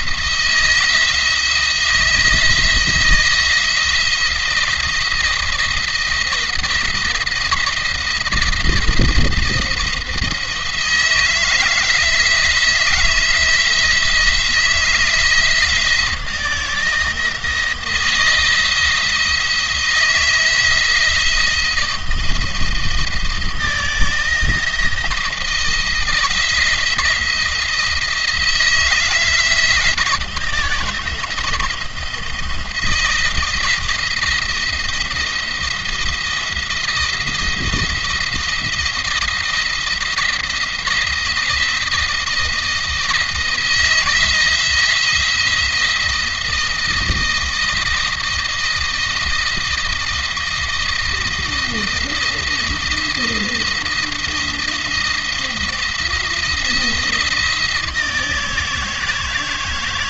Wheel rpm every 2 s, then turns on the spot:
170, 170, 170, 170, 170, 160, 170, 160, 160, 160, 160, 160, 160, 170, 170, 160, 170, 170, 170, 170, 160, 170, 170, 170, 170, 170, 170, 170, 170, 160.
none